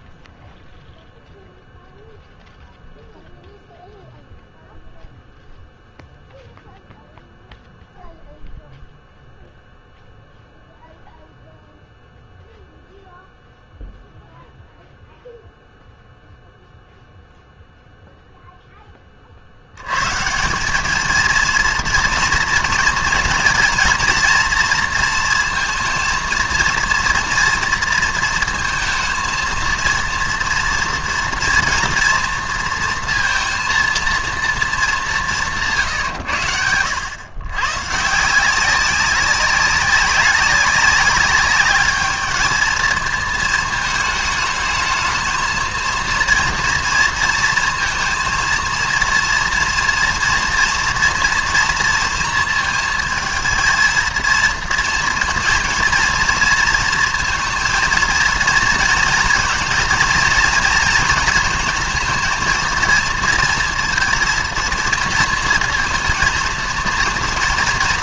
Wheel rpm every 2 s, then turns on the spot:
0, 0, 0, 0, 0, 0, 0, 0, 0, 0, 130, 230, 230, 230, 230, 230, 230, 230, 140, 150, 200, 210, 220, 230, 230, 230, 230, 230, 230, 230, 230, 220, 230, 230.
none